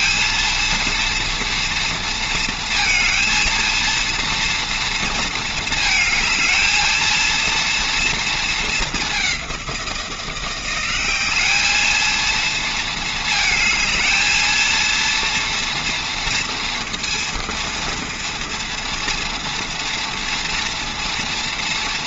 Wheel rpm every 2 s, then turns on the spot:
230, 230, 230, 220, 210, 190, 220, 230, 230, 240, 230.
none